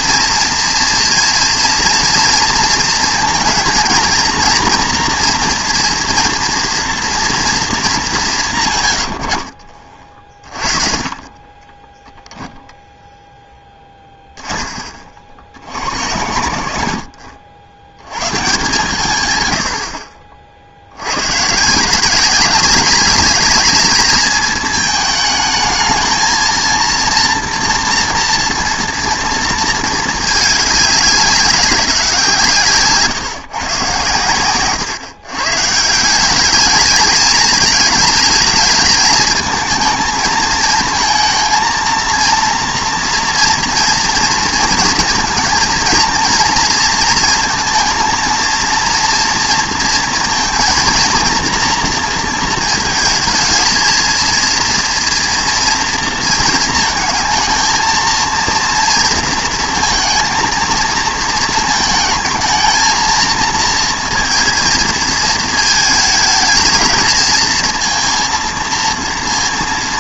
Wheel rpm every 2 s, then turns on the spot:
230, 230, 230, 230, 110, 30, 0, 30, 80, 150, 60, 190, 220, 230, 230, 210, 150, 120, 210, 210, 220, 230, 230, 230, 230, 230, 230, 230, 220, 230, 230, 230, 220, 220, 230.
10-12